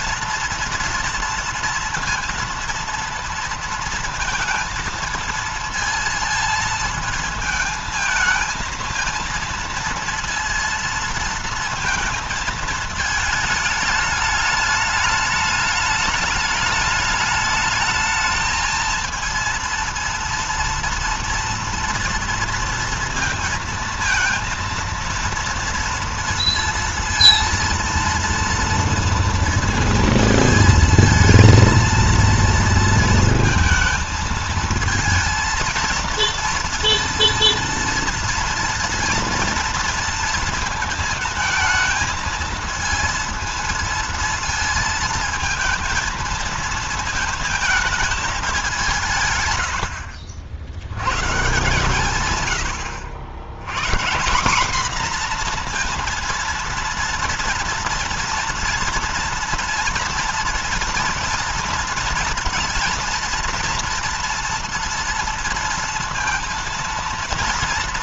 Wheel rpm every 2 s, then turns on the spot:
230, 230, 230, 230, 220, 230, 220, 210, 210, 220, 230, 230, 230, 230, 230, 220, 230, 220, 230, 230, 220, 220, 230, 230, 190, 70, 120, 210, 230, 230, 230, 230, 230, 230.
none